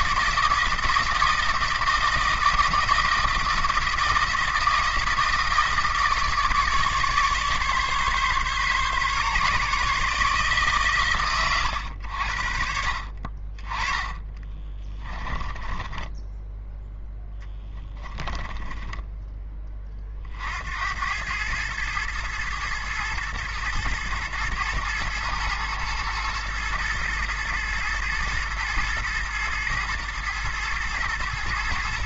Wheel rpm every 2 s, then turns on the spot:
160, 160, 160, 150, 140, 140, 60, 20, 10, 10, 80, 110, 110, 110, 110, 110.
14-16 18-20